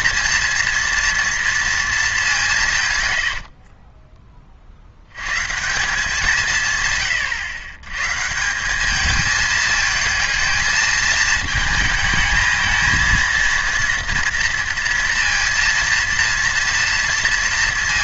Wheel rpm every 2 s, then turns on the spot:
230, 140, 50, 150, 190, 220, 220, 230, 230.
none